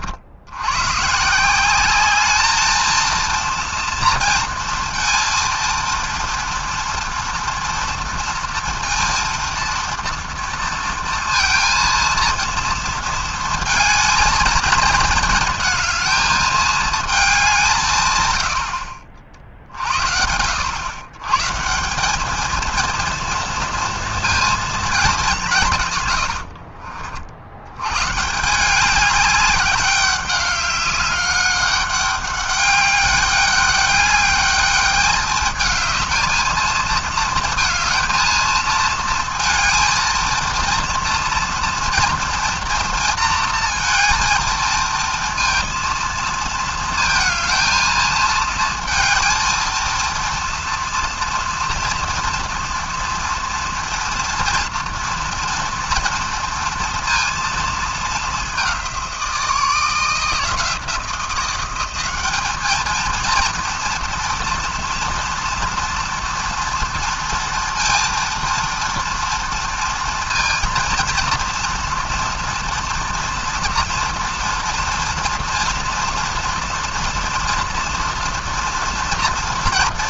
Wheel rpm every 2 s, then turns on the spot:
120, 220, 230, 230, 230, 230, 230, 220, 220, 70, 110, 230, 220, 50, 180, 200, 200, 210, 230, 220, 230, 230, 230, 230, 220, 230, 230, 230, 230, 190, 170, 220, 240, 230, 230, 230, 230, 230, 240, 240.
26-28